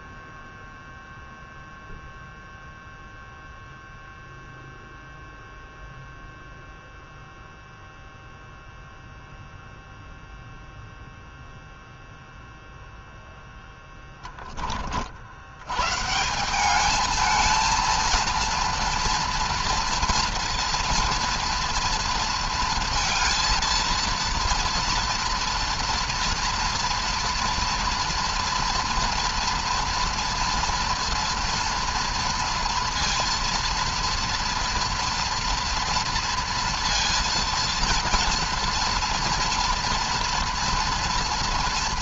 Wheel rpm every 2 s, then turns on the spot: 0, 0, 0, 0, 0, 0, 0, 20, 190, 230, 230, 230, 230, 230, 230, 230, 230, 230, 230, 240, 230.
none